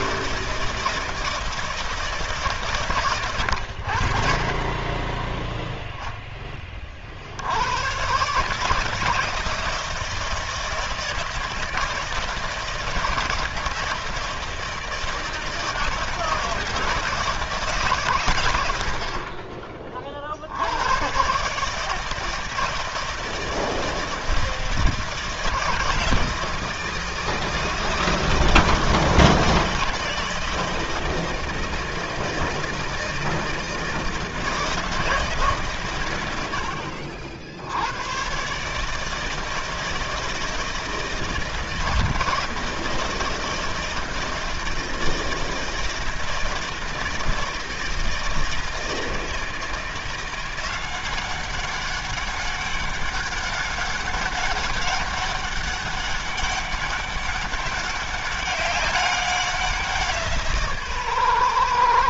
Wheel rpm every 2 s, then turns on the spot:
160, 140, 40, 10, 140, 160, 160, 160, 160, 110, 60, 160, 160, 160, 160, 160, 160, 160, 100, 140, 160, 160, 160, 160, 160, 180, 200, 200, 190, 200, 160.
none